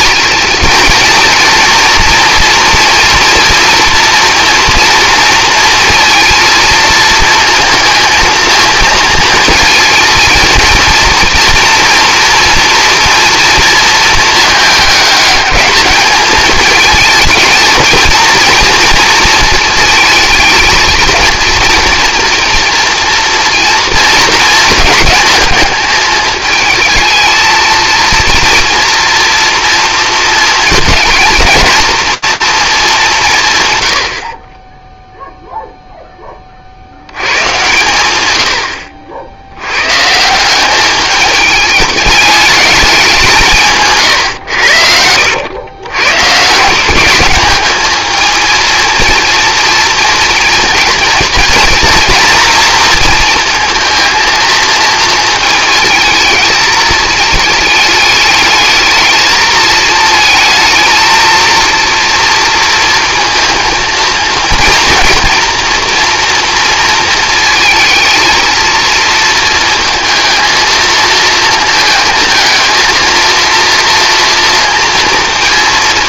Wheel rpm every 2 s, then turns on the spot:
230, 240, 230, 230, 230, 230, 230, 220, 220, 230, 220, 230, 220, 220, 230, 220, 210, 10, 60, 80, 200, 210, 90, 180, 230, 230, 230, 230, 220, 220, 220, 230, 230, 230, 230, 230, 220, 230.
44-46